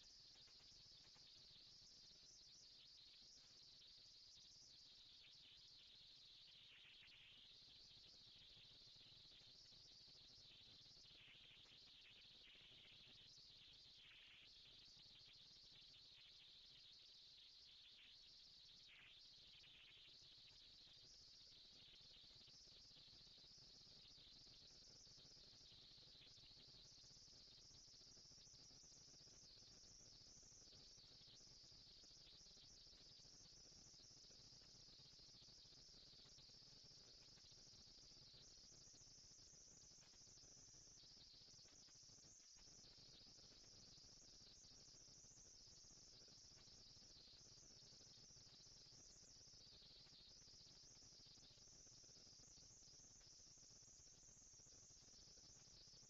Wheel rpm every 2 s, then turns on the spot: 200, 230, 230, 230, 230, 230, 230, 230, 230, 230, 230, 230, 230, 230, 230, 230, 230, 230, 220, 180, 130, 200, 230, 220, 220, 230, 230, 220.
none